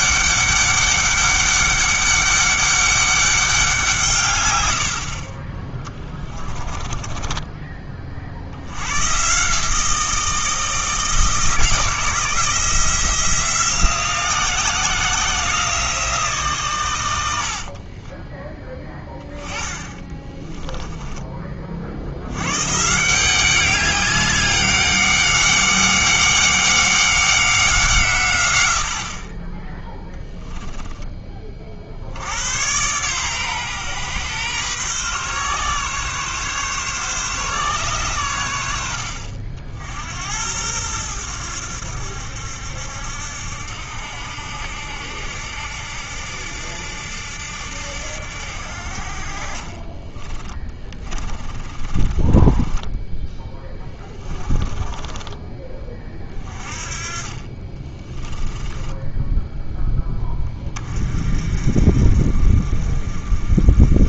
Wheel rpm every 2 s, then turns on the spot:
200, 200, 80, 30, 120, 160, 170, 170, 120, 10, 20, 140, 190, 190, 70, 10, 120, 130, 140, 70, 100, 70, 70, 70, 60, 20, 10, 10, 40, 10, 20, 40.
6-8 20-22 50-60